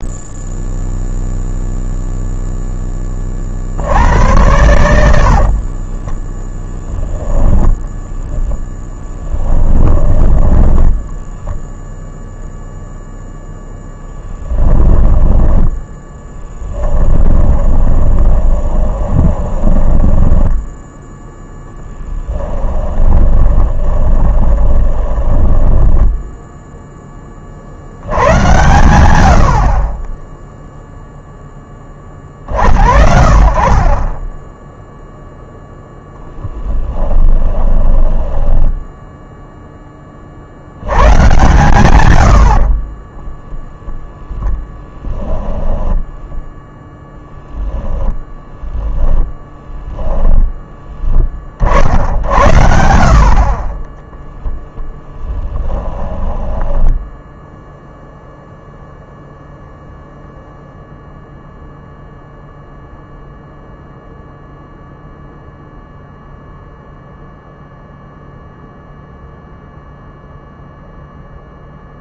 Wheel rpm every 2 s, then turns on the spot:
0, 10, 100, 10, 10, 10, 0, 10, 10, 20, 10, 20, 20, 10, 100, 0, 50, 0, 10, 10, 90, 50, 10, 0, 0, 10, 80, 0, 10, 0, 0, 0, 0, 0, 0, 0.
8-12 14-26 36-40 42-46